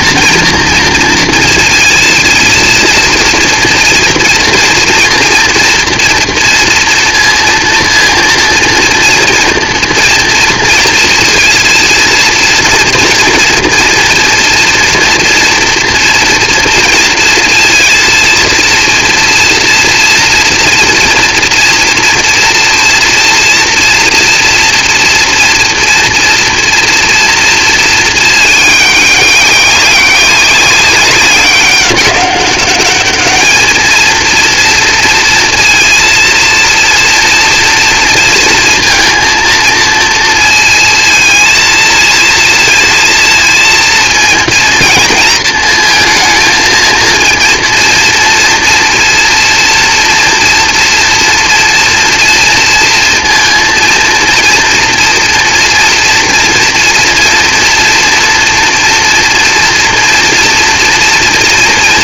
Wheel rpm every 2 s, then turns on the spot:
230, 230, 240, 230, 230, 230, 230, 230, 230, 230, 230, 230, 230, 230, 200, 200, 200, 230, 230, 230, 230, 230, 230, 230, 240, 230, 230, 230, 240, 240, 230.
none